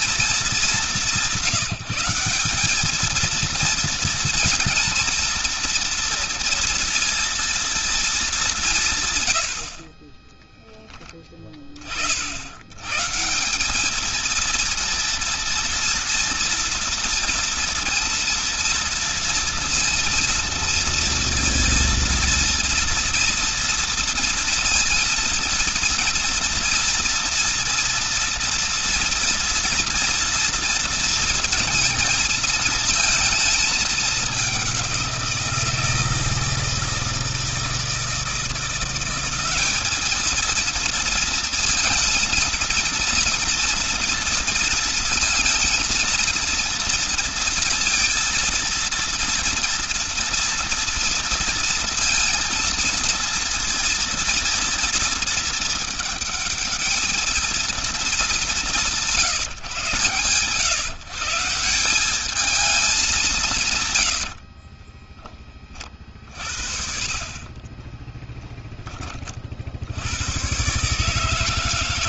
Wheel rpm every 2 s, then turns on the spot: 210, 190, 230, 230, 190, 10, 70, 220, 240, 230, 230, 230, 230, 230, 230, 230, 220, 200, 160, 170, 220, 230, 230, 230, 230, 230, 230, 230, 220, 200, 130, 210, 60, 50, 10, 110.
64-68